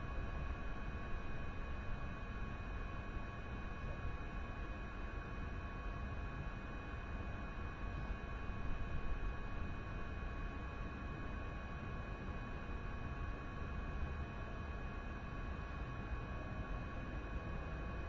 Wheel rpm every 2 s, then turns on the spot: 0, 0, 0, 0, 0, 0, 0, 0, 0.
none